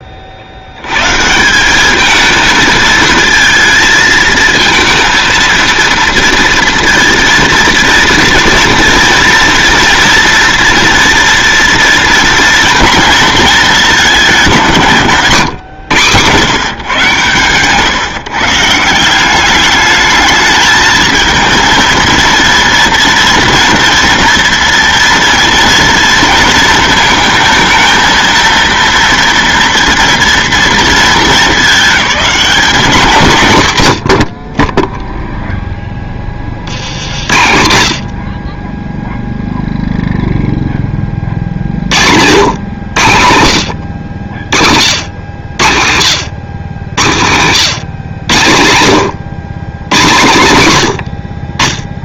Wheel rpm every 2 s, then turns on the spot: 80, 220, 220, 230, 230, 230, 230, 170, 130, 170, 220, 230, 230, 220, 230, 230, 200, 20, 50, 30, 10, 110, 80, 100, 100, 120.
none